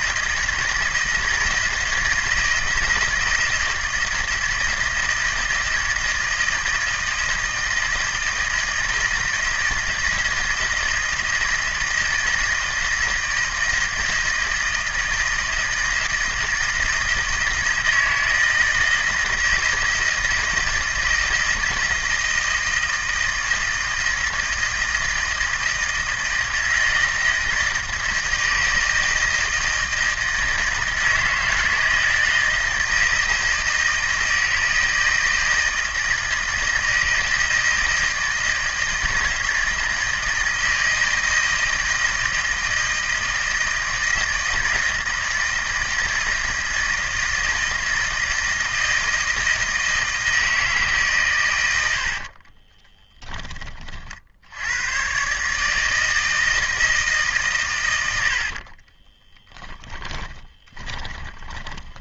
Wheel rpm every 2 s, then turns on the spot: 160, 160, 160, 160, 160, 160, 160, 160, 160, 160, 160, 160, 160, 160, 160, 160, 160, 160, 160, 170, 160, 160, 160, 160, 160, 150, 30, 90, 160, 40, 20.
52-54 58-62